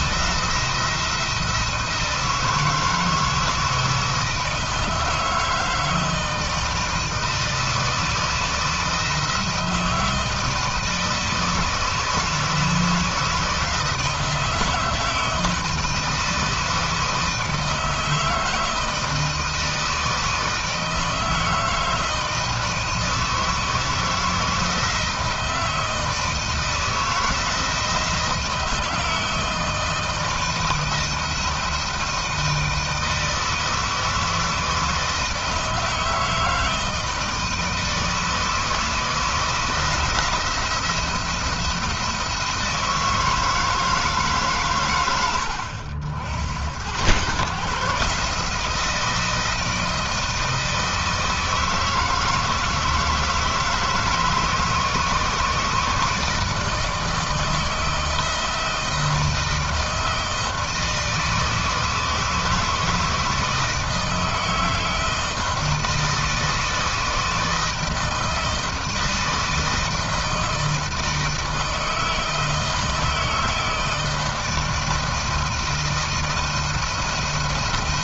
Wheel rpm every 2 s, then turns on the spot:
170, 160, 160, 160, 160, 160, 160, 160, 160, 160, 160, 160, 160, 160, 160, 160, 160, 160, 160, 160, 170, 160, 100, 110, 160, 160, 160, 160, 160, 160, 160, 160, 160, 160, 160, 160, 160, 160, 170.
none